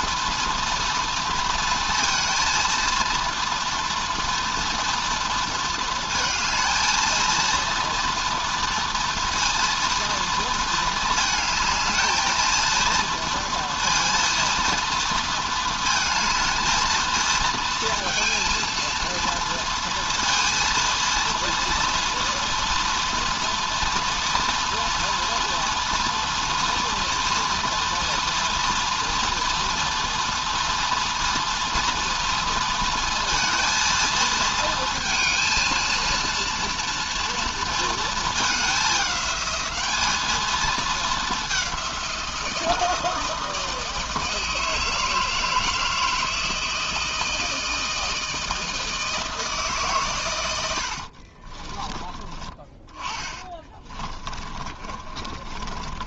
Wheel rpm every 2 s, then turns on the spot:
230, 230, 230, 230, 240, 220, 230, 230, 220, 230, 230, 230, 240, 230, 230, 230, 230, 230, 230, 210, 220, 160, 160, 160, 160, 70, 30, 30.
50-56